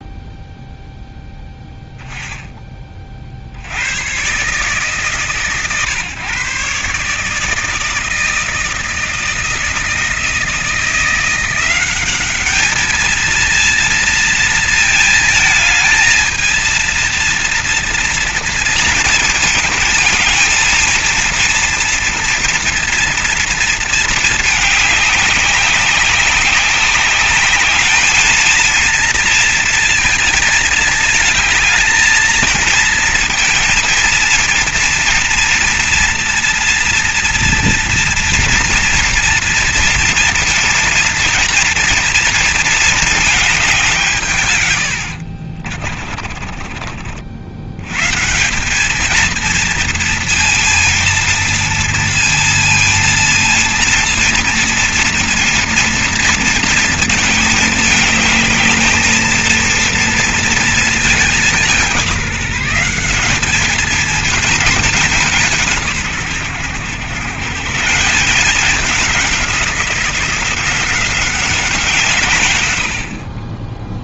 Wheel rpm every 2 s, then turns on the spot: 0, 20, 130, 130, 160, 160, 210, 230, 230, 230, 220, 230, 210, 200, 230, 220, 230, 230, 230, 230, 230, 220, 100, 30, 200, 230, 230, 230, 230, 220, 220, 180, 210, 120, 190, 180, 110.
none